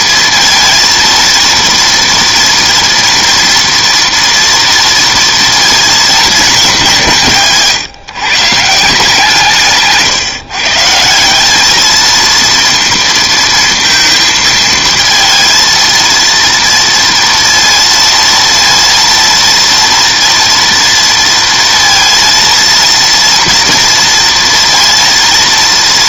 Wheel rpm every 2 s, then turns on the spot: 230, 230, 230, 210, 150, 150, 230, 230, 230, 230, 230, 230, 230.
none